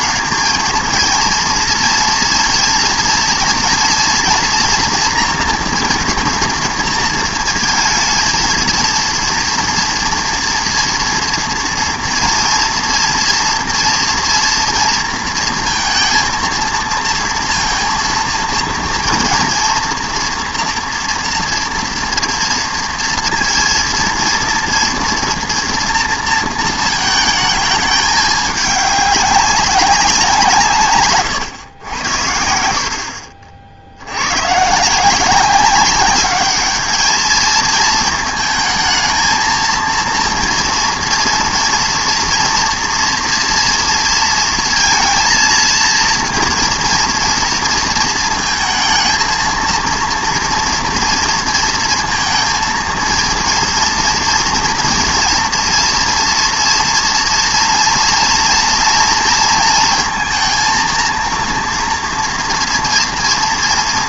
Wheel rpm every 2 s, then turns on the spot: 220, 230, 230, 230, 230, 240, 230, 230, 230, 230, 240, 230, 230, 230, 210, 170, 70, 140, 210, 230, 230, 230, 230, 230, 220, 230, 230, 230, 230, 230, 230, 230.
none